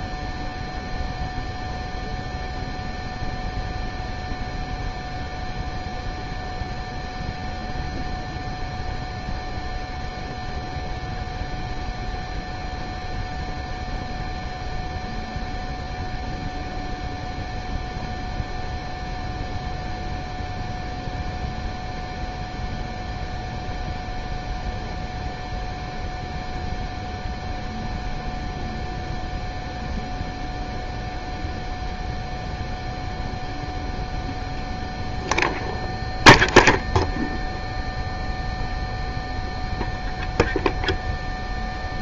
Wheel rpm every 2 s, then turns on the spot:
0, 0, 0, 0, 0, 0, 0, 0, 0, 0, 0, 0, 0, 0, 0, 0, 0, 0, 0, 0, 0.
none